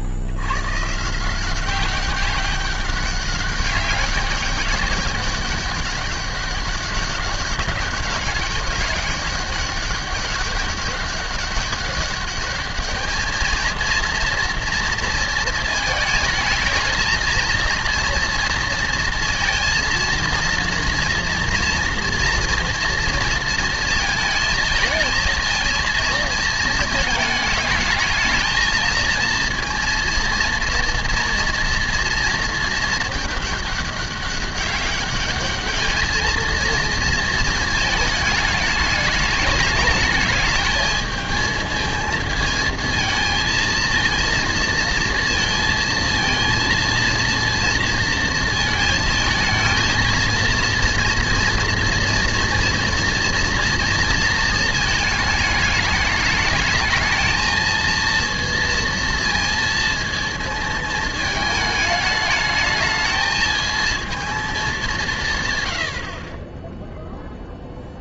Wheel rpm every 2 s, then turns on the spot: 110, 200, 200, 200, 190, 200, 210, 230, 220, 230, 230, 230, 220, 220, 220, 230, 220, 200, 230, 210, 220, 220, 230, 230, 230, 230, 230, 220, 210, 230, 220, 210, 210, 20.
none